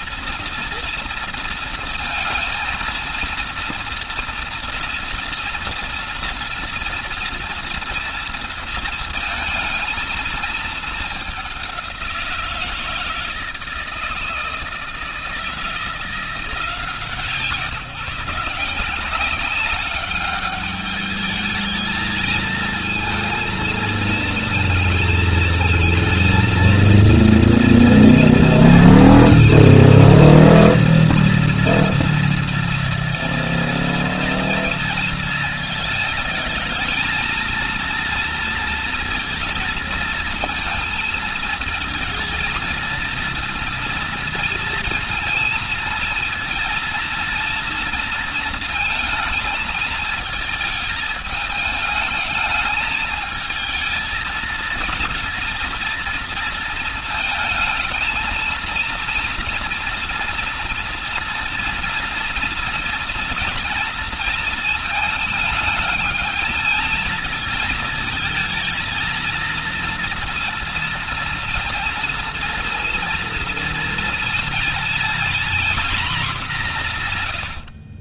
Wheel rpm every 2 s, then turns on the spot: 230, 230, 230, 230, 230, 210, 170, 160, 160, 180, 210, 230, 230, 230, 230, 230, 230, 230, 230, 230, 220, 230, 230, 230, 220, 220, 220, 230, 220, 230, 230, 230, 220, 220, 230, 230, 230, 240, 140.
none